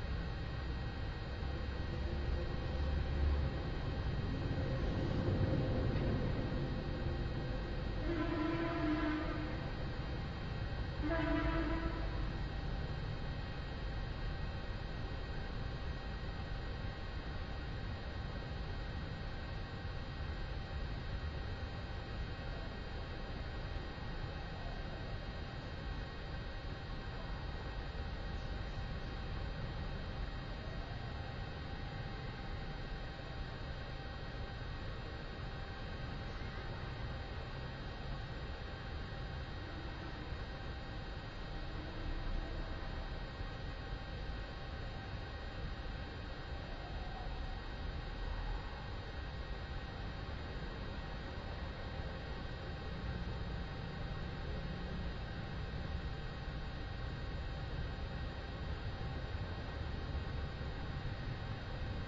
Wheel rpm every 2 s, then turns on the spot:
0, 0, 0, 0, 0, 0, 0, 0, 0, 0, 0, 0, 0, 0, 0, 0, 0, 0, 0, 0, 0, 0, 0, 0, 0, 0, 0, 0, 0, 0, 0.
none